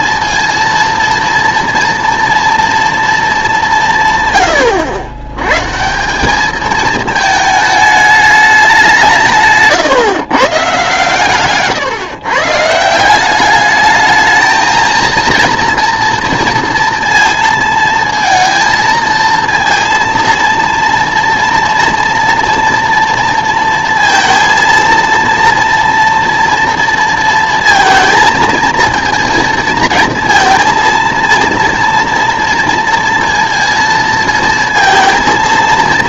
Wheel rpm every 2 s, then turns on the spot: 230, 230, 110, 210, 190, 140, 150, 220, 230, 230, 230, 240, 230, 230, 230, 230, 230, 230.
none